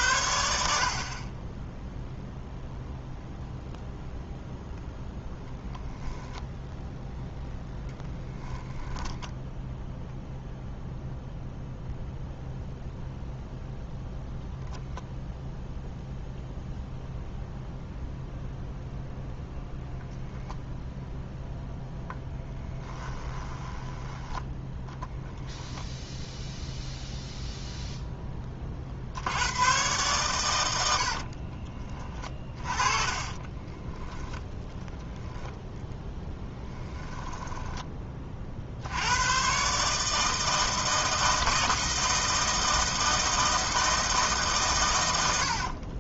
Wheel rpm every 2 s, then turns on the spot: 50, 0, 0, 10, 10, 0, 0, 0, 0, 0, 0, 10, 20, 0, 70, 80, 20, 0, 10, 80, 160, 160, 90.
8-10 22-24 30-34 36-38